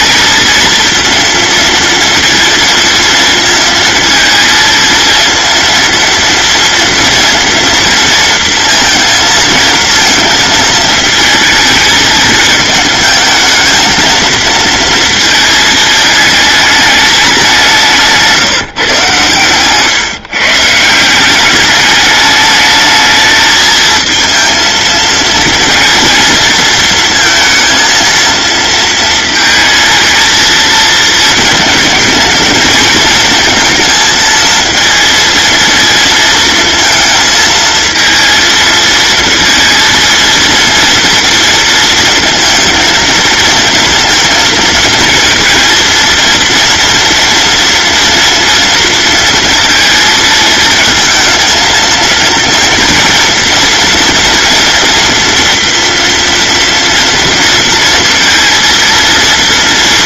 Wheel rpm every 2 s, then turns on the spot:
230, 230, 230, 230, 230, 230, 220, 230, 210, 150, 160, 220, 230, 230, 230, 230, 230, 230, 230, 230, 230, 230, 230, 230, 230, 220, 230, 230, 230, 230.
none